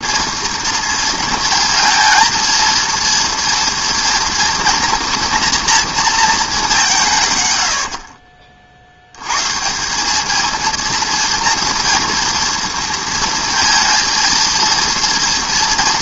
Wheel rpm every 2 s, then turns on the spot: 230, 230, 230, 200, 50, 220, 230, 230.
none